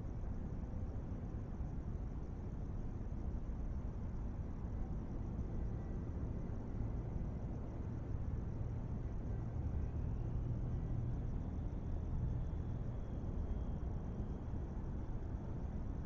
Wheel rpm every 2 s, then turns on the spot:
0, 0, 0, 0, 0, 0, 0, 0.
none